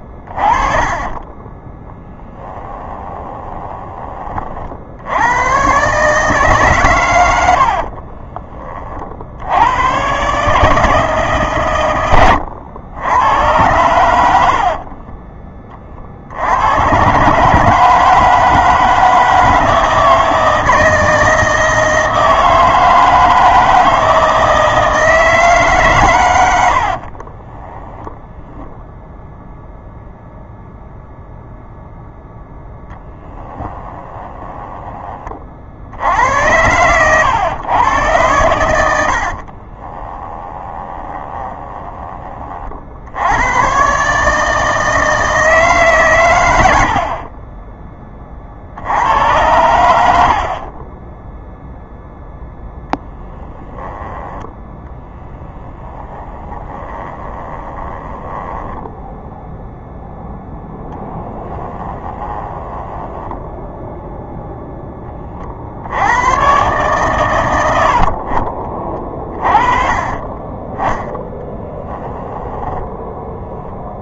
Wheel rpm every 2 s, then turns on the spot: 20, 10, 70, 130, 40, 160, 90, 50, 110, 160, 160, 160, 160, 100, 0, 0, 10, 20, 110, 80, 20, 60, 160, 30, 80, 30, 10, 20, 20, 10, 10, 10, 10, 130, 30, 10, 10.
2-4 14-16 26-28 32-34 36-38 40-42 50-52 54-60 62-64 68-70 72-74